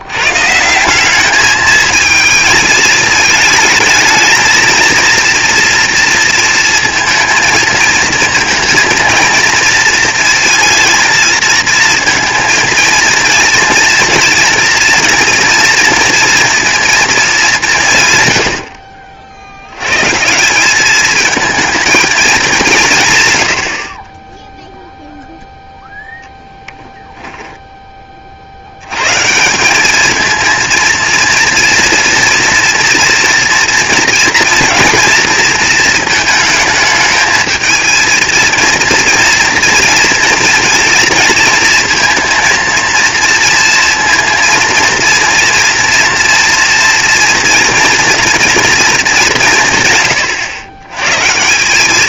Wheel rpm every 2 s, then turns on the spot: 150, 220, 220, 230, 230, 230, 230, 230, 230, 100, 180, 190, 0, 10, 70, 230, 230, 230, 220, 230, 230, 230, 230, 230, 230, 110.
none